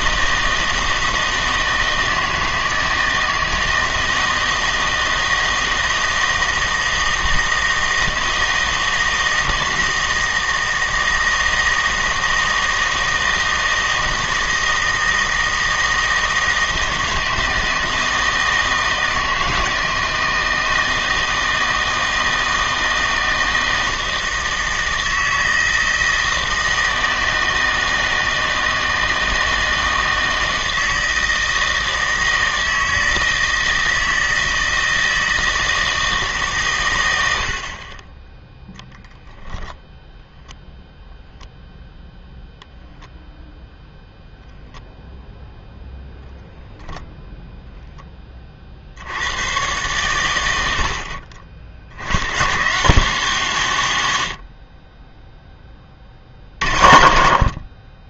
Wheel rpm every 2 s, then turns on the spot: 160, 160, 160, 160, 160, 160, 160, 160, 160, 160, 160, 160, 160, 160, 160, 160, 160, 160, 120, 0, 0, 0, 0, 0, 50, 70, 150, 60, 70.
none